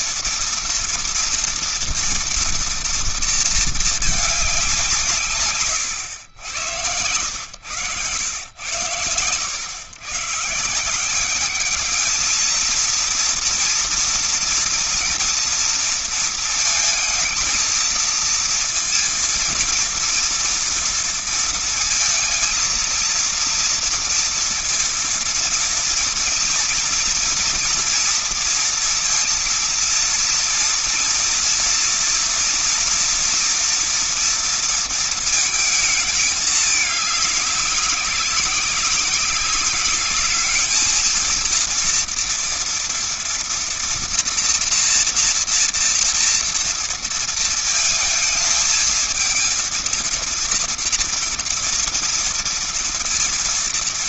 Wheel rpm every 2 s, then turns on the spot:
240, 230, 200, 100, 100, 130, 220, 230, 230, 230, 230, 230, 230, 230, 230, 230, 240, 230, 210, 190, 210, 230, 230, 230, 220, 230, 230.
none